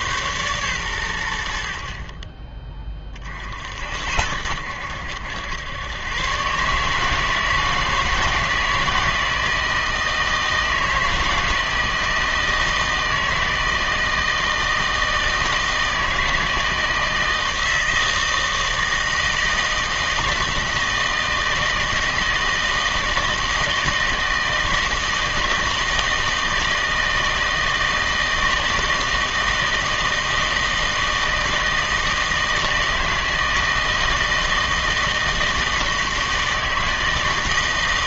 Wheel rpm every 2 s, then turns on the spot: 110, 20, 80, 140, 160, 160, 160, 160, 160, 160, 160, 160, 160, 160, 160, 160, 160, 160, 160.
none